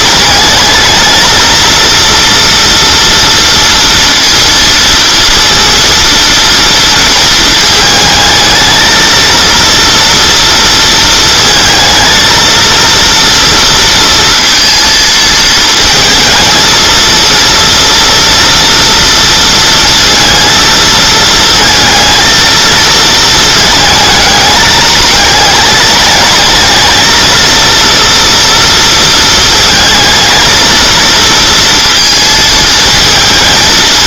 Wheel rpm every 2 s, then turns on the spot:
220, 230, 230, 230, 220, 230, 230, 230, 220, 230, 230, 230, 210, 220, 230, 220, 220.
none